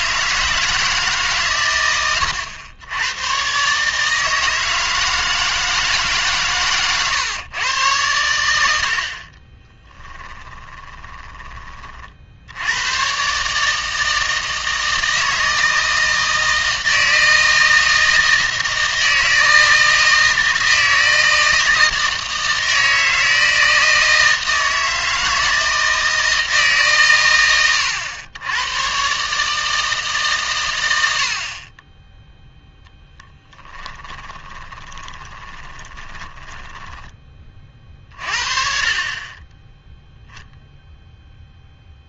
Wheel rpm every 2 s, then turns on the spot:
160, 100, 160, 130, 80, 20, 90, 160, 160, 160, 160, 160, 160, 150, 110, 110, 0, 20, 10, 40, 0.
10-12 34-38